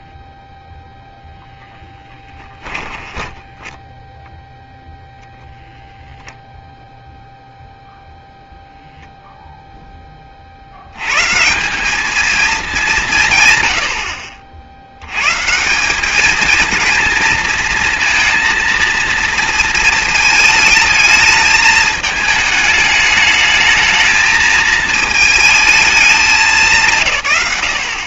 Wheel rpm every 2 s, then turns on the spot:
0, 10, 0, 0, 0, 140, 160, 140, 230, 230, 220, 210, 220, 80.
2-4